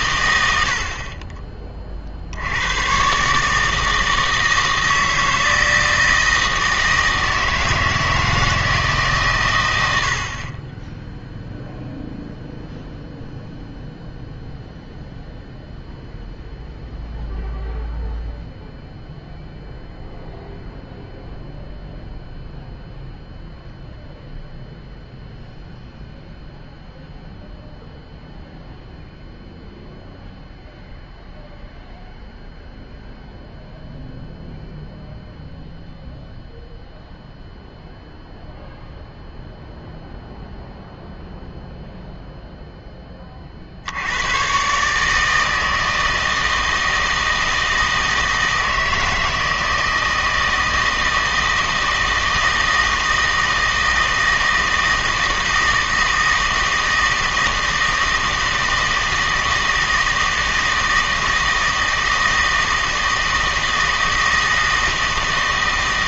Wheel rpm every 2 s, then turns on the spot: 70, 110, 160, 160, 160, 20, 0, 0, 0, 0, 0, 0, 0, 0, 0, 0, 0, 0, 0, 0, 0, 0, 140, 160, 160, 160, 160, 160, 160, 160, 160, 160, 160.
none